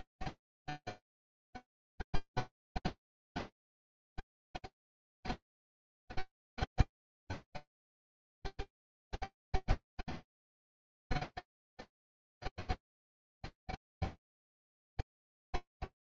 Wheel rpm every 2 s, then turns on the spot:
0, 0, 0, 0, 0, 0, 0, 0.
none